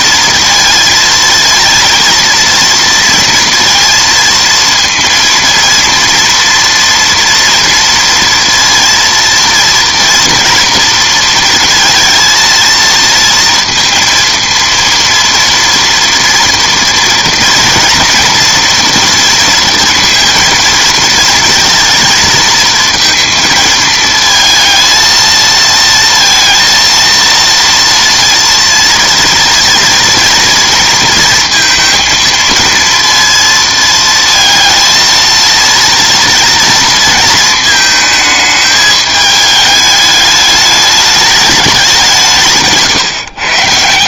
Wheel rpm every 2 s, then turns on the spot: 230, 230, 230, 230, 230, 230, 230, 230, 240, 240, 230, 230, 220, 230, 230, 230, 230, 230, 230, 220, 210, 150.
none